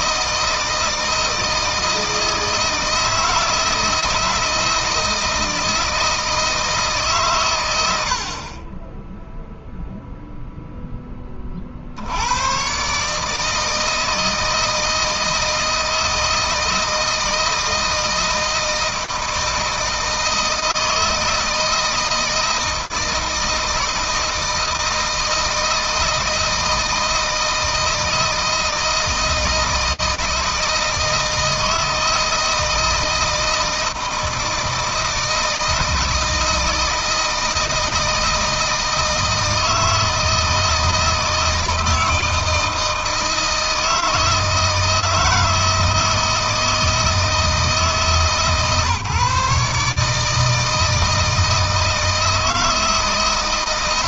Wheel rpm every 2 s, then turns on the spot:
160, 160, 160, 150, 20, 10, 130, 160, 160, 160, 160, 160, 160, 160, 160, 160, 160, 160, 160, 160, 160, 160, 160, 160, 150, 160, 160.
none